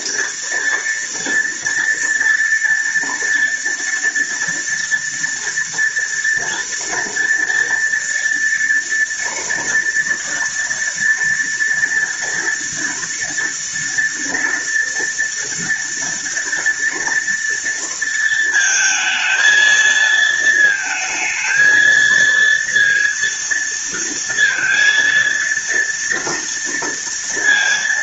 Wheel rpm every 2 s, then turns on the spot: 230, 230, 230, 240, 230, 230, 230, 230, 240, 220, 220, 230, 230, 230.
none